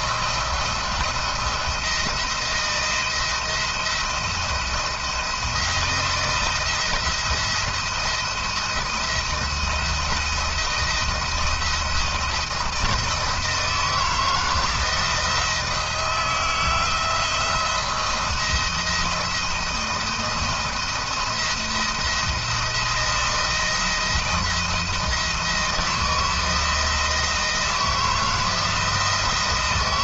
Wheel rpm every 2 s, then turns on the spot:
170, 160, 170, 160, 160, 170, 170, 160, 160, 170, 170, 170, 170, 170, 160.
none